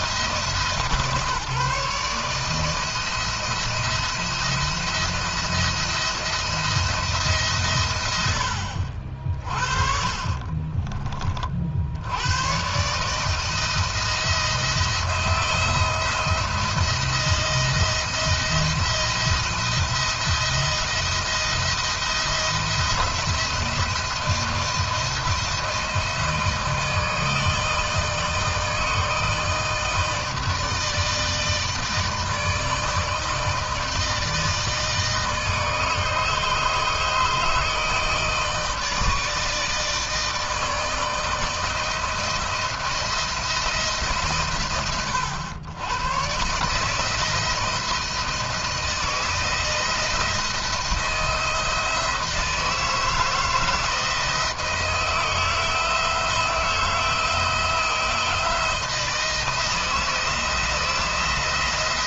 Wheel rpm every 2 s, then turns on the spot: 140, 170, 170, 140, 60, 50, 160, 170, 170, 170, 160, 160, 160, 160, 160, 160, 160, 160, 150, 160, 160, 160, 100, 160, 170, 170, 160, 160, 170, 170, 170.
none